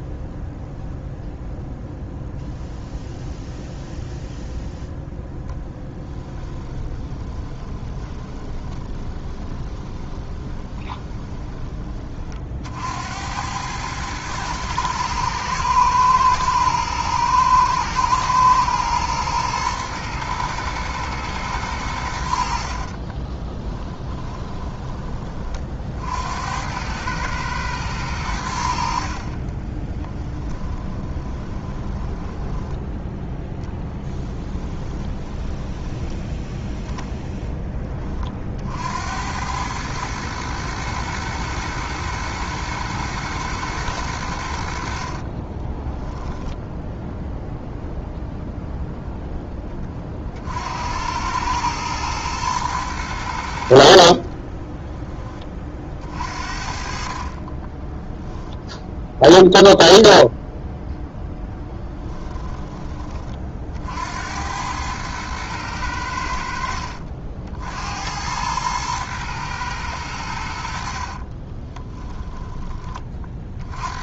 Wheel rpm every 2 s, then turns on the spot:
0, 0, 0, 20, 20, 20, 60, 110, 110, 120, 120, 40, 20, 100, 70, 20, 10, 10, 10, 70, 110, 110, 60, 0, 0, 80, 110, 20, 50, 0, 0, 20, 100, 60, 110, 60, 30.
6-12 22-24 30-32 34-36 44-46 54-56 70-72